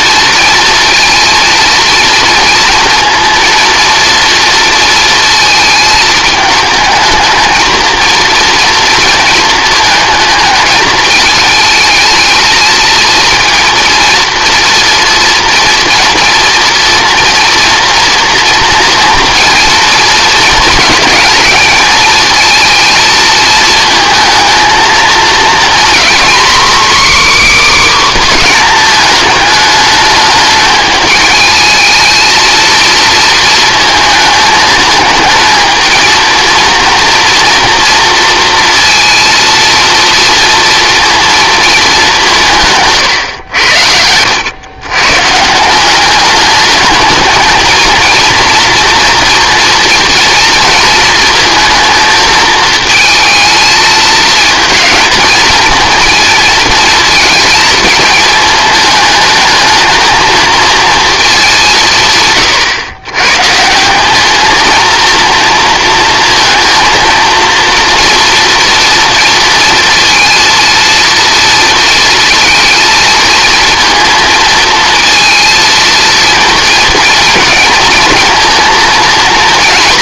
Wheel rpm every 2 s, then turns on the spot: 230, 230, 230, 220, 230, 220, 230, 230, 230, 230, 220, 230, 220, 280, 230, 210, 230, 220, 230, 230, 240, 150, 110, 210, 230, 230, 220, 220, 220, 220, 230, 110, 230, 230, 230, 230, 230, 230, 230, 230.
none